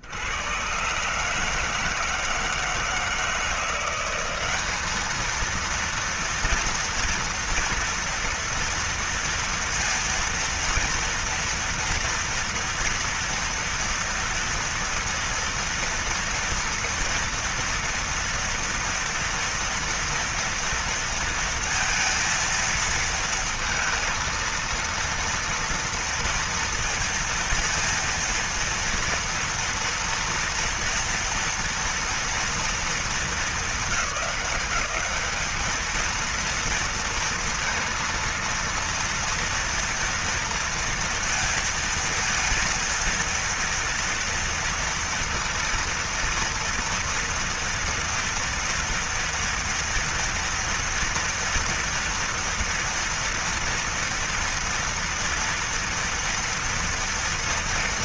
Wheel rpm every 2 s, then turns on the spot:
80, 160, 190, 230, 230, 230, 230, 240, 230, 230, 230, 230, 230, 230, 230, 230, 230, 210, 220, 230, 230, 230, 230, 230, 230, 230, 230, 230, 230.
none